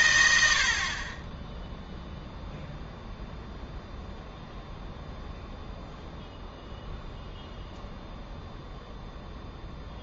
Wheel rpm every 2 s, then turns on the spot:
50, 0, 0, 0, 0.
none